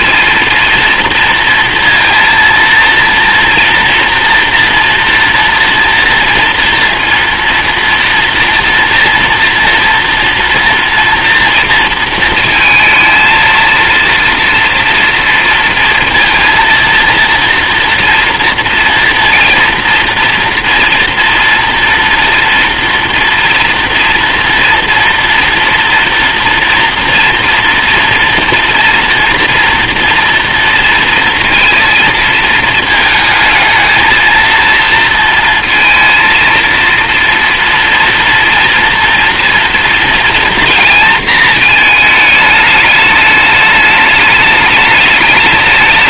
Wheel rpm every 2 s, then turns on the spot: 230, 230, 230, 230, 230, 230, 220, 230, 230, 230, 240, 230, 230, 230, 240, 230, 220, 230, 230, 240, 230, 210, 210.
none